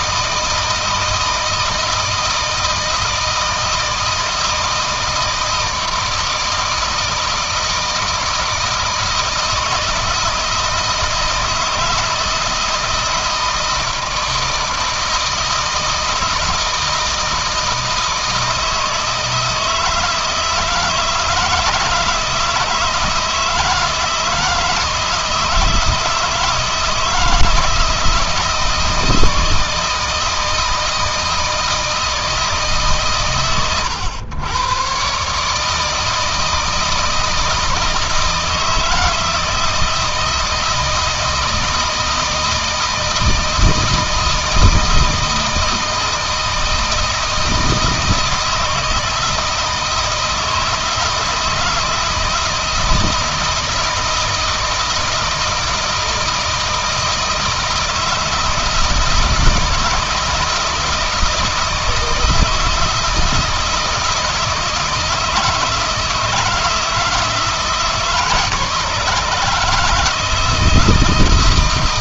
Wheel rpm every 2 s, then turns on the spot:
160, 160, 160, 160, 160, 160, 160, 160, 160, 160, 160, 160, 160, 160, 160, 160, 140, 120, 160, 160, 160, 160, 160, 160, 160, 160, 160, 160, 160, 160, 160, 160, 160, 160, 150, 160.
none